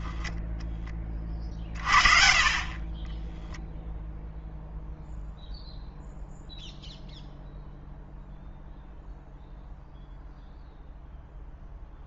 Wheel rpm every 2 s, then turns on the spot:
0, 30, 0, 0, 0, 0.
none